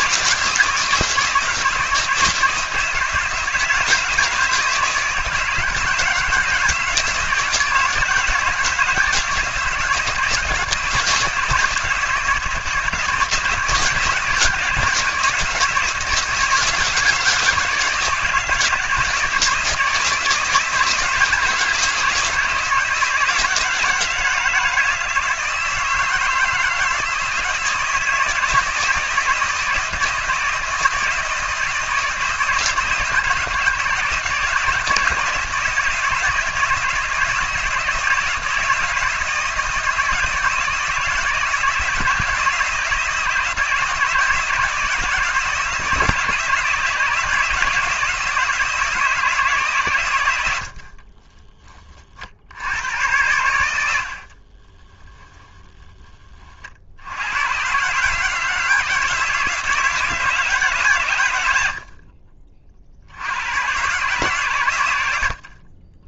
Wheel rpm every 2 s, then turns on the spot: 170, 160, 160, 160, 160, 160, 160, 170, 160, 160, 160, 160, 160, 160, 160, 160, 160, 160, 160, 160, 160, 160, 160, 160, 160, 50, 90, 20, 60, 160, 140, 60, 100.
50-52 54-56